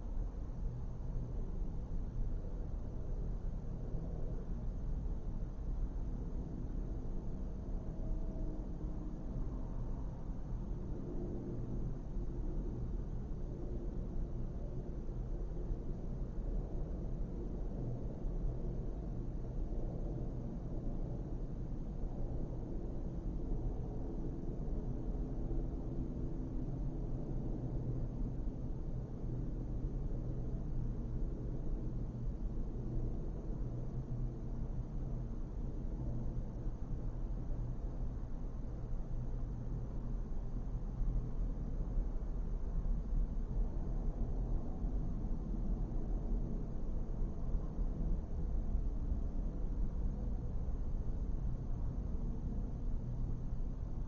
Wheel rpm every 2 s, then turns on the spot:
0, 0, 0, 0, 0, 0, 0, 0, 0, 0, 0, 0, 0, 0, 0, 0, 0, 0, 0, 0, 0, 0, 0, 0, 0, 0, 0.
none